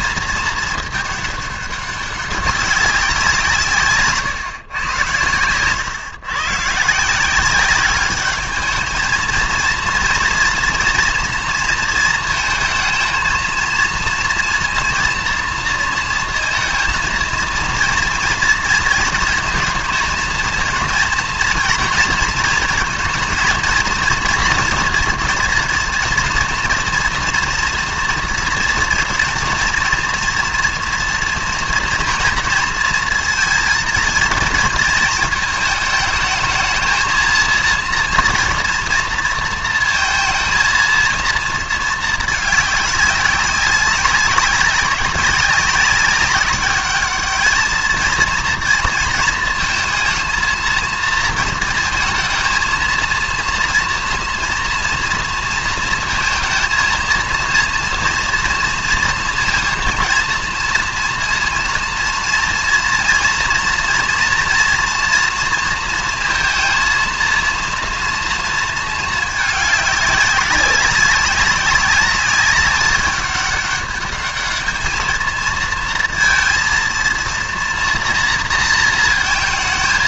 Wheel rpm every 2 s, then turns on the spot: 220, 200, 120, 150, 210, 240, 220, 230, 230, 230, 230, 220, 230, 230, 230, 230, 230, 220, 220, 230, 230, 210, 190, 200, 230, 230, 230, 230, 230, 230, 230, 230, 240, 230, 230, 190, 200, 210, 230, 230.
none